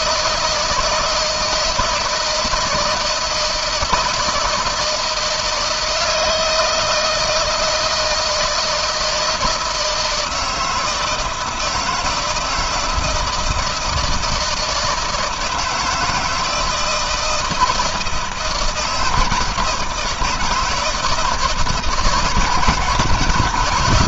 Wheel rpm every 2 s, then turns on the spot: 160, 170, 160, 160, 160, 160, 160, 160, 160, 160, 160, 170.
none